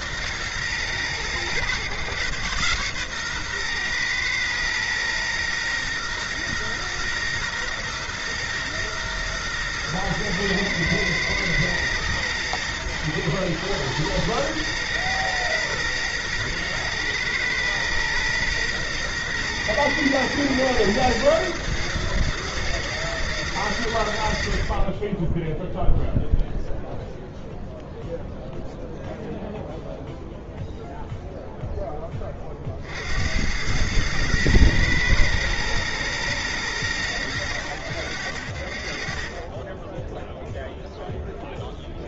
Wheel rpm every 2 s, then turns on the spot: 110, 120, 120, 120, 120, 120, 110, 120, 120, 120, 110, 120, 40, 0, 0, 0, 40, 120, 110, 30, 0.
none